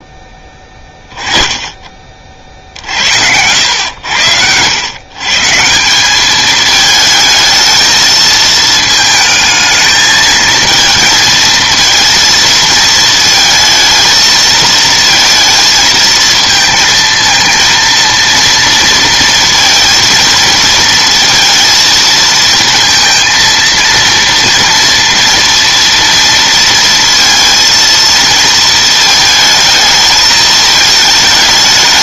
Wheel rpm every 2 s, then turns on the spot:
10, 50, 90, 210, 220, 220, 230, 220, 230, 230, 230, 230, 230, 230, 220, 220.
none